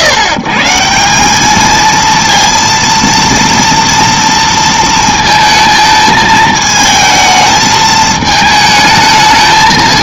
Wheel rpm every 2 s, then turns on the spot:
150, 230, 230, 220, 220.
none